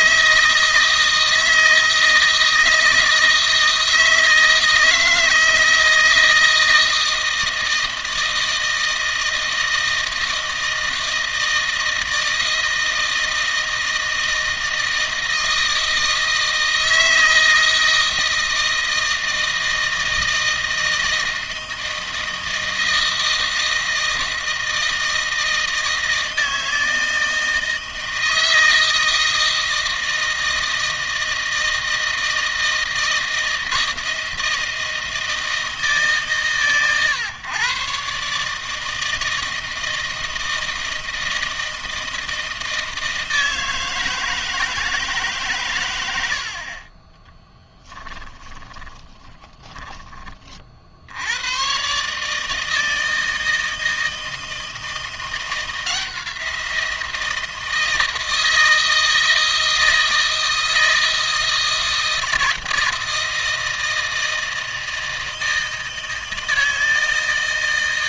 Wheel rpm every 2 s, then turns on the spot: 160, 160, 160, 160, 160, 160, 160, 160, 160, 160, 160, 160, 160, 160, 160, 160, 160, 160, 130, 150, 160, 160, 160, 60, 20, 60, 150, 160, 170, 160, 160, 160, 160, 160.
48-50